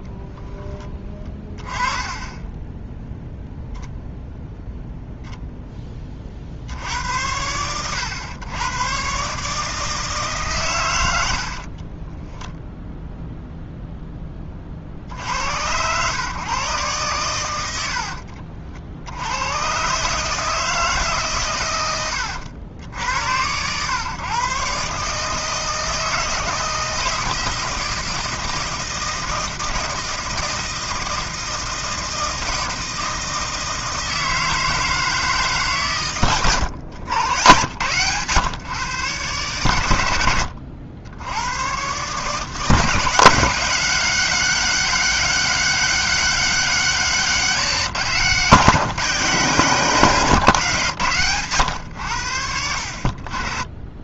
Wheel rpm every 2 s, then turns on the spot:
10, 10, 0, 60, 110, 110, 0, 40, 120, 70, 160, 80, 130, 160, 160, 160, 160, 160, 110, 130, 90, 170, 190, 190, 170, 140, 60.
none